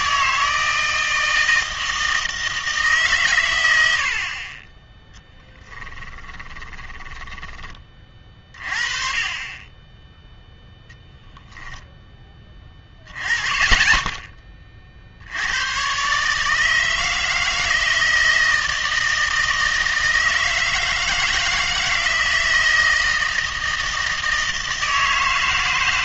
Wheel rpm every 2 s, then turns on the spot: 160, 150, 20, 10, 40, 0, 20, 30, 160, 160, 160, 160, 160.
6-8